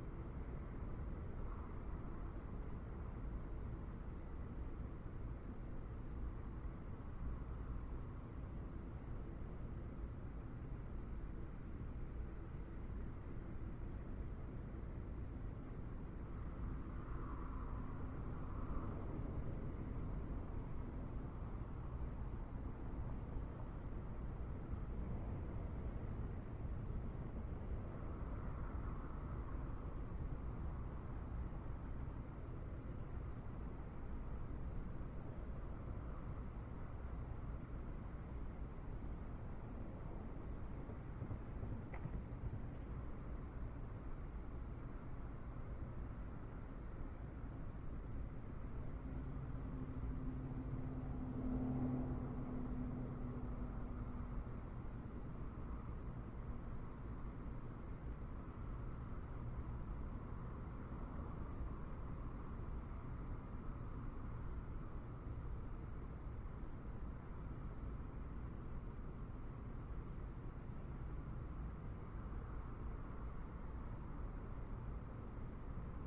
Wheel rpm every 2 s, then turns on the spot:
0, 0, 0, 0, 0, 0, 0, 0, 0, 0, 0, 0, 0, 0, 0, 0, 0, 0, 0, 0, 0, 0, 0, 0, 0, 0, 0, 0, 0, 0, 0, 0, 0, 0, 0, 0, 0, 0.
none